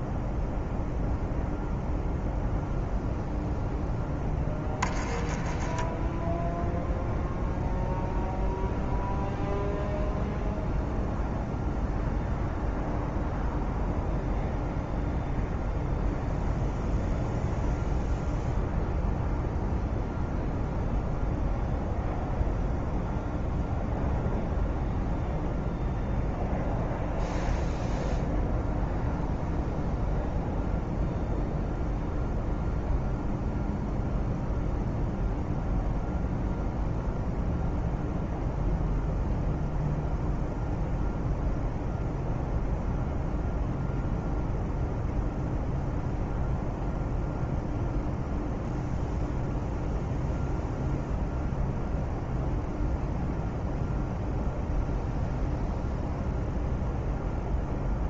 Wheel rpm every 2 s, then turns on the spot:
0, 0, 10, 0, 0, 0, 0, 0, 0, 0, 0, 0, 0, 0, 0, 0, 0, 0, 0, 0, 0, 0, 0, 0, 0, 0, 0, 0, 0.
none